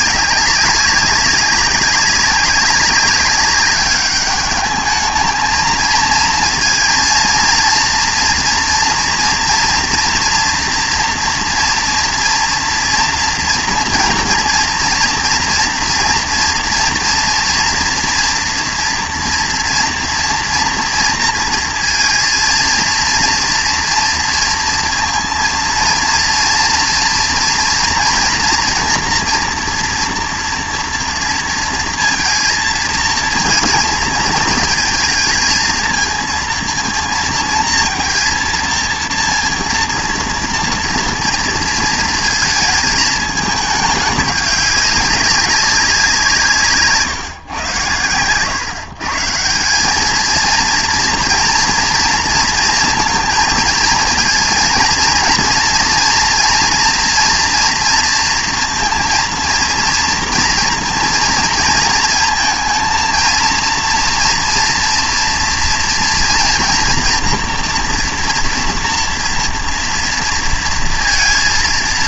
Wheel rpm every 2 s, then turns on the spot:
200, 190, 210, 230, 230, 240, 240, 230, 240, 240, 230, 230, 230, 230, 230, 240, 230, 220, 230, 230, 240, 230, 200, 160, 120, 220, 230, 230, 230, 230, 230, 220, 240, 240, 230, 230.
none